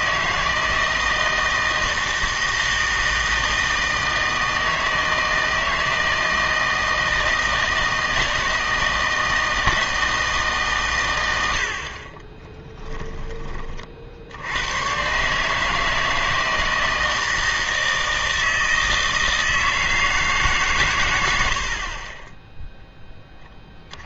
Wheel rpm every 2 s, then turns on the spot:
160, 160, 160, 160, 160, 140, 10, 100, 160, 160, 130, 0.
12-14